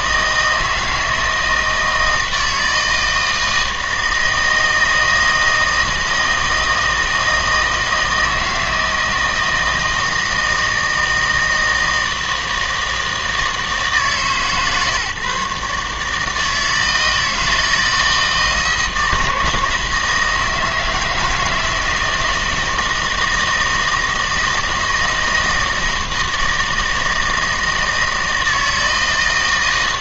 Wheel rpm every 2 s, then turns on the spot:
160, 160, 160, 160, 160, 160, 160, 150, 160, 160, 160, 160, 160, 160, 160.
none